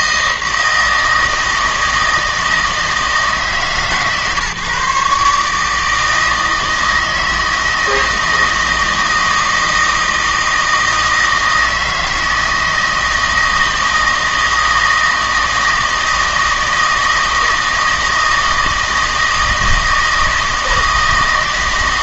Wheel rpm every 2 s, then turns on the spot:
160, 160, 140, 160, 160, 160, 160, 160, 160, 160, 160.
none